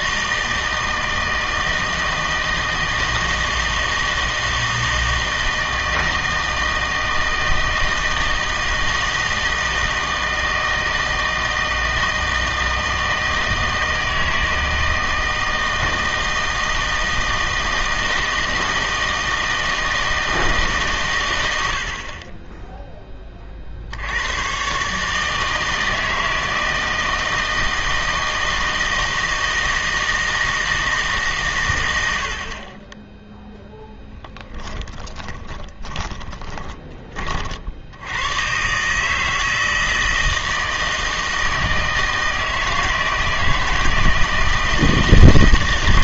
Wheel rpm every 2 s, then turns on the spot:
160, 160, 160, 160, 160, 160, 160, 160, 160, 160, 150, 10, 130, 160, 160, 160, 20, 20, 20, 130, 160, 160, 160.
34-38